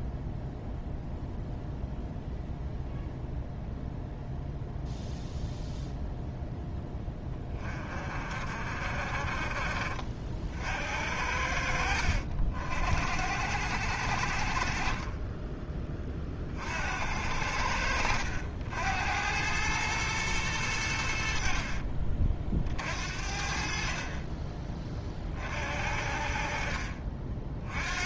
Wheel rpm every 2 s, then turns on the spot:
0, 0, 0, 0, 40, 70, 50, 40, 50, 80, 90, 50, 30, 40.
none